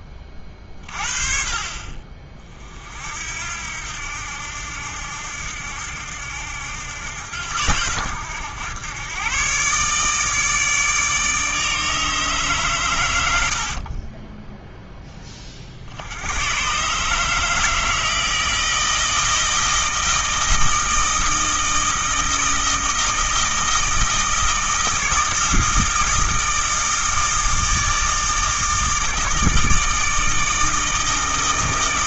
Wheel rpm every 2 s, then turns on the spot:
40, 50, 70, 80, 110, 150, 120, 10, 140, 160, 160, 160, 160, 160, 160, 160.
none